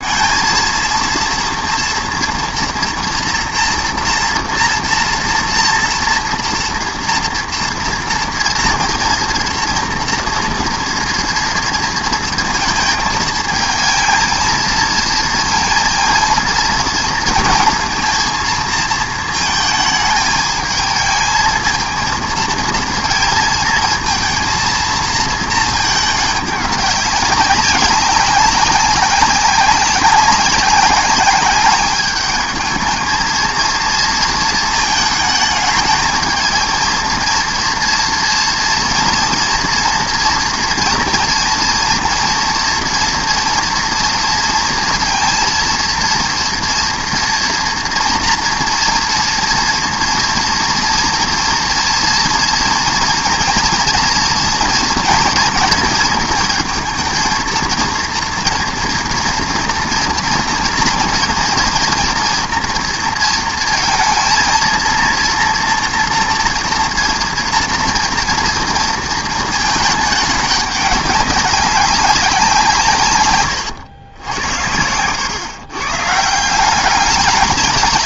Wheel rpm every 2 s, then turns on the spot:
220, 230, 230, 230, 230, 240, 230, 220, 230, 230, 220, 220, 230, 200, 190, 200, 210, 220, 220, 230, 230, 230, 230, 230, 230, 230, 230, 230, 220, 240, 230, 230, 230, 230, 230, 210, 180, 80, 170.
none